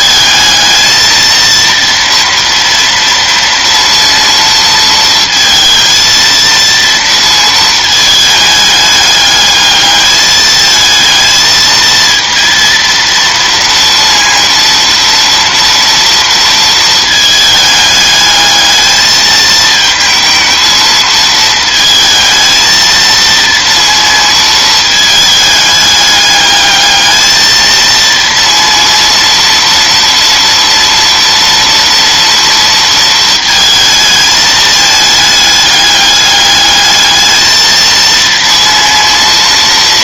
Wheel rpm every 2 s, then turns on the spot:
220, 230, 230, 230, 210, 220, 230, 230, 230, 220, 220, 220, 220, 210, 230, 230, 230, 220, 210, 230.
none